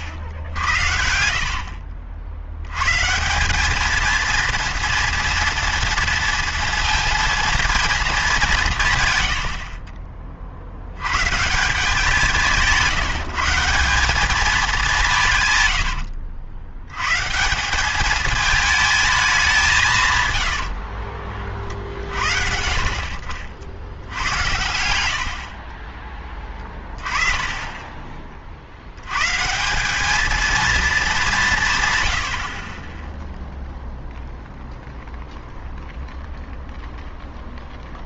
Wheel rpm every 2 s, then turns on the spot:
80, 100, 230, 230, 160, 70, 170, 200, 90, 220, 70, 60, 80, 20, 70, 220, 30, 0, 0.
20-22 24-28